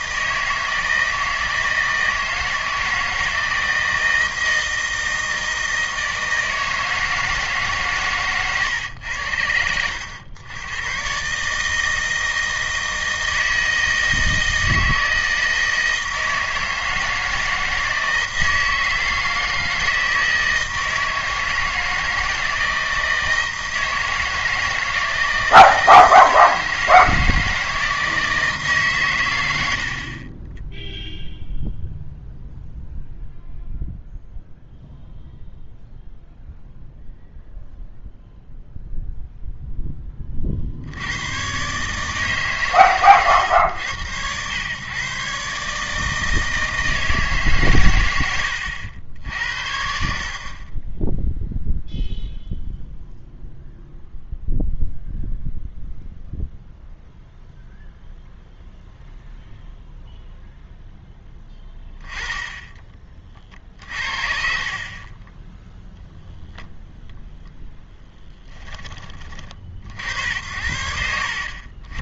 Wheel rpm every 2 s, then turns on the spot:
160, 160, 160, 160, 120, 110, 160, 160, 160, 160, 160, 160, 160, 160, 160, 10, 0, 0, 0, 0, 60, 130, 110, 160, 90, 40, 0, 0, 0, 0, 0, 20, 40, 0, 20, 70.
none